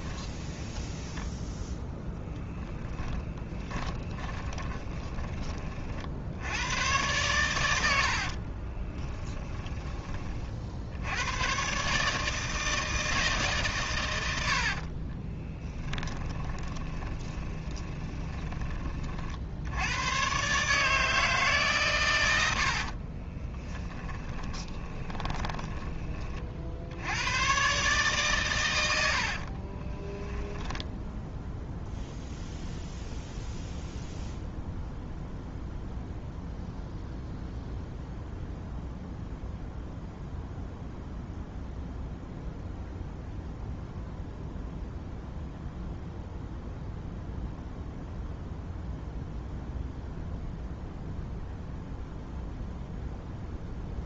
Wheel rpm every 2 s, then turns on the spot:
10, 10, 20, 110, 20, 70, 160, 50, 20, 30, 150, 60, 20, 80, 90, 0, 0, 0, 0, 0, 0, 0, 0, 0, 0, 0, 0.
0-2 4-6 8-10 14-18 22-26 28-30